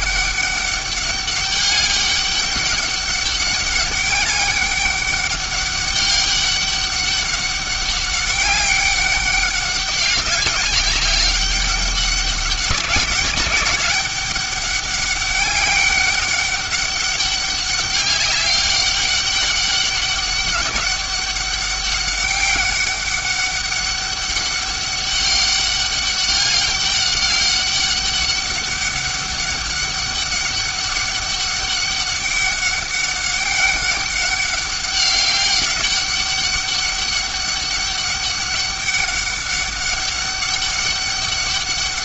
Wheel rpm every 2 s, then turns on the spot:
200, 200, 200, 200, 200, 200, 190, 200, 200, 200, 200, 200, 200, 200, 200, 200, 200, 200, 200, 200, 200.
none